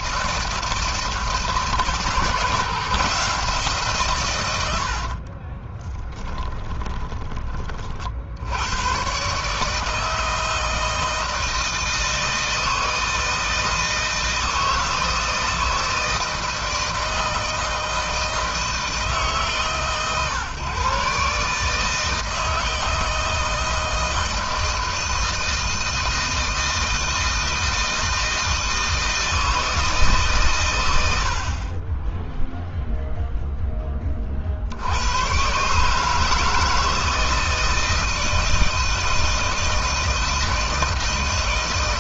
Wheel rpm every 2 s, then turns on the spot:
160, 160, 70, 20, 110, 160, 160, 160, 160, 160, 130, 160, 160, 160, 160, 110, 0, 70, 160, 160, 160.
4-8